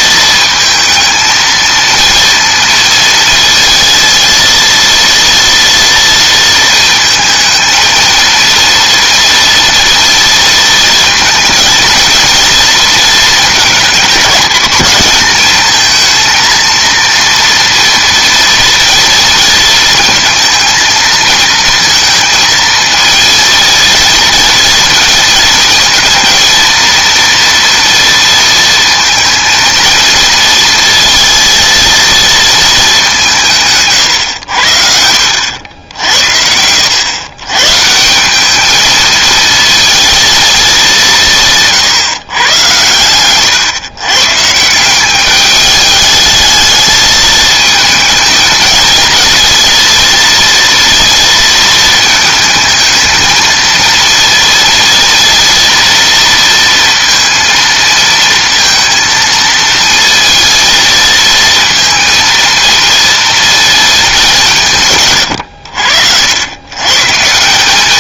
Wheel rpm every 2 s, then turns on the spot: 220, 230, 230, 230, 230, 230, 230, 200, 230, 230, 230, 220, 230, 230, 220, 220, 210, 70, 90, 220, 210, 110, 160, 220, 220, 230, 220, 230, 230, 230, 230, 230, 160, 110.
none